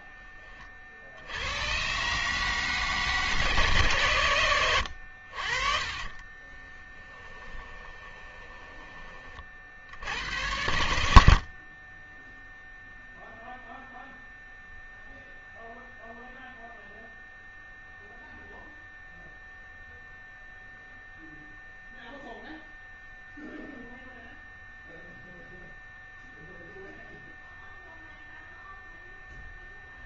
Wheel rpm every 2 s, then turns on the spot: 40, 150, 100, 20, 20, 90, 0, 0, 0, 0, 0, 0, 0, 0, 0.
6-10